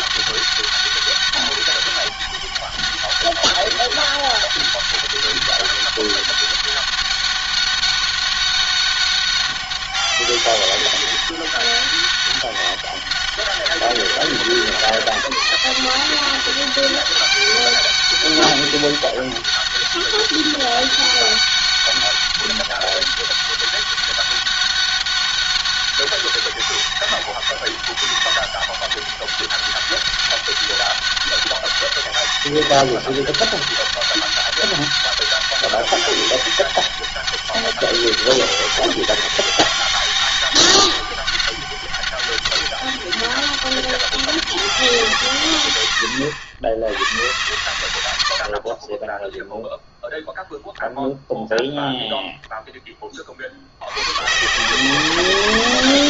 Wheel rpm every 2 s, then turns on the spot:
200, 200, 200, 200, 200, 200, 200, 190, 190, 200, 200, 200, 200, 200, 200, 200, 200, 200, 200, 200, 200, 200, 200, 100, 50, 0, 0, 140.
48-50